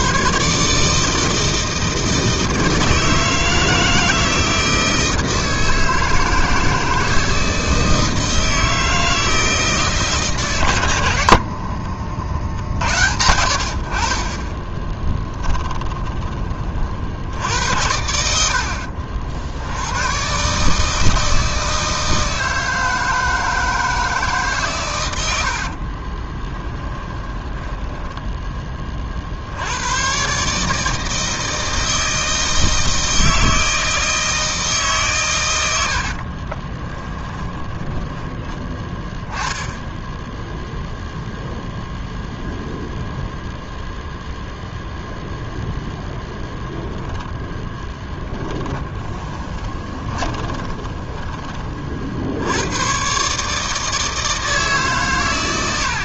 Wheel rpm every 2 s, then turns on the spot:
150, 160, 160, 160, 160, 110, 60, 20, 50, 50, 150, 160, 120, 10, 30, 150, 160, 140, 20, 10, 0, 0, 0, 0, 10, 20, 100, 150.
14-16 18-20 26-28 36-38 48-52